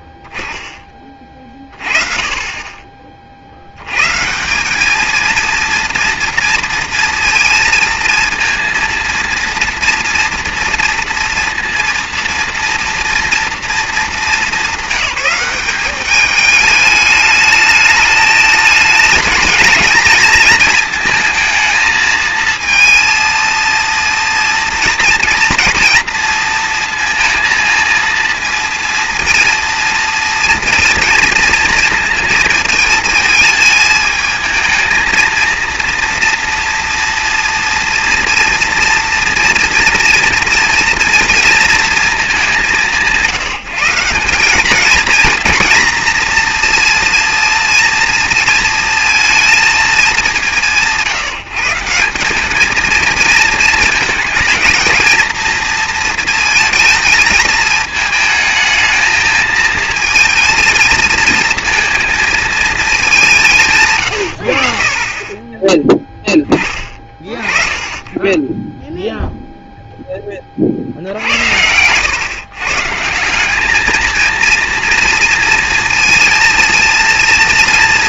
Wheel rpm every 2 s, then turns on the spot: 0, 30, 170, 230, 230, 230, 240, 200, 210, 220, 220, 220, 230, 230, 230, 230, 230, 220, 230, 230, 230, 200, 190, 230, 230, 190, 200, 230, 230, 220, 220, 220, 70, 20, 10, 40, 130, 230, 230.
none